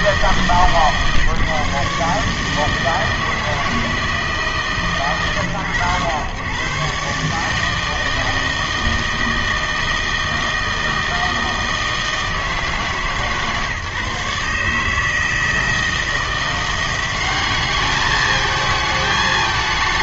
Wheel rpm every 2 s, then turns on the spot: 150, 150, 130, 120, 160, 160, 150, 150, 180, 220.
none